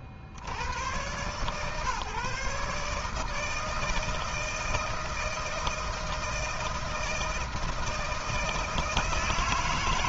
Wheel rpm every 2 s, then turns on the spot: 80, 150, 160, 160, 160.
none